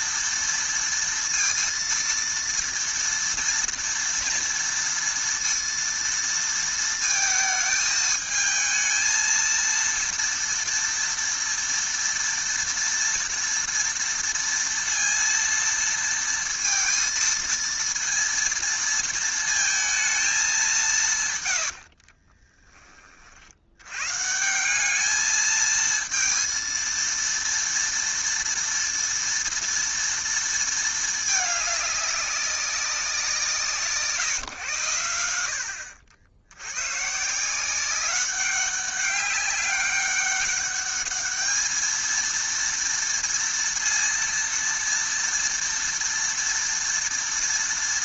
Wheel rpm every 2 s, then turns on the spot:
230, 230, 230, 230, 220, 230, 230, 230, 230, 230, 190, 20, 190, 230, 230, 220, 190, 120, 100, 200, 200, 230, 240, 230.
none